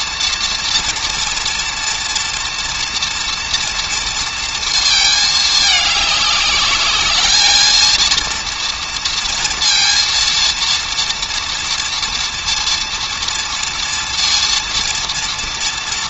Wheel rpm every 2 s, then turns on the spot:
230, 230, 220, 210, 230, 230, 230, 230.
none